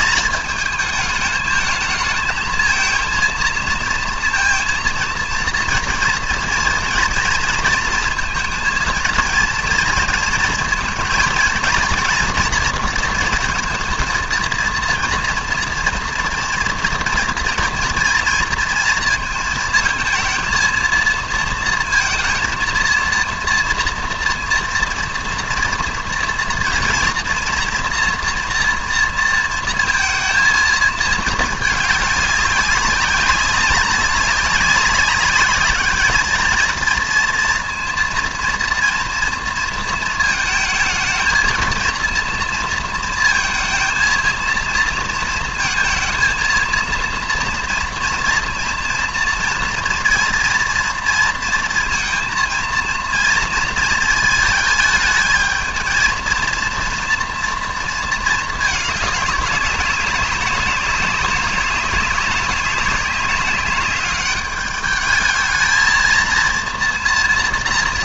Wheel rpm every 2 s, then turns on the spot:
220, 230, 230, 230, 220, 230, 230, 230, 230, 230, 230, 230, 230, 230, 240, 230, 200, 200, 230, 230, 220, 230, 230, 230, 230, 230, 230, 220, 230, 210, 200, 190, 210, 230.
none